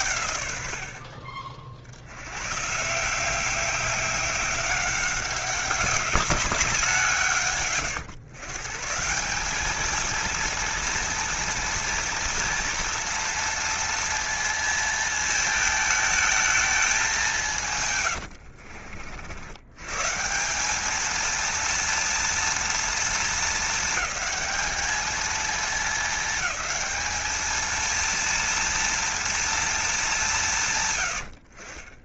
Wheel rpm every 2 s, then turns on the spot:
80, 130, 190, 180, 150, 230, 230, 230, 210, 60, 190, 230, 220, 200, 230, 140.
18-20